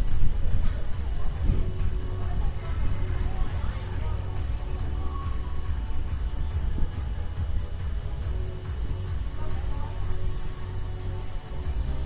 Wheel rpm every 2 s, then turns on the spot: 0, 0, 0, 0, 0, 0.
none